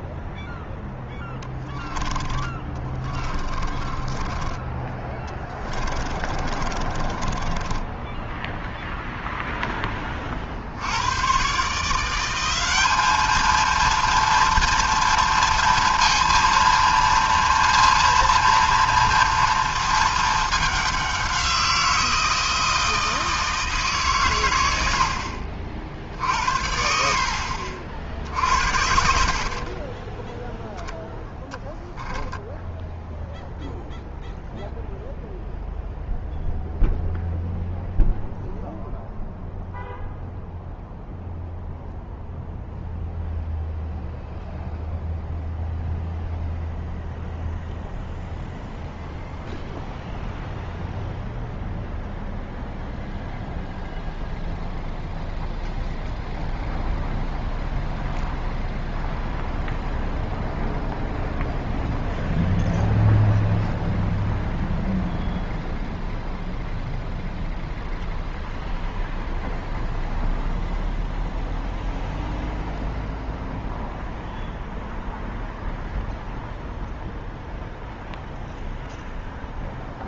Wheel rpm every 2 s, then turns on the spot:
0, 20, 10, 30, 0, 70, 200, 230, 230, 230, 210, 160, 90, 70, 70, 10, 0, 0, 0, 0, 0, 0, 0, 0, 0, 0, 0, 0, 0, 0, 0, 0, 0, 0, 0, 0, 0, 0, 0, 0.
2-4 6-8 26-30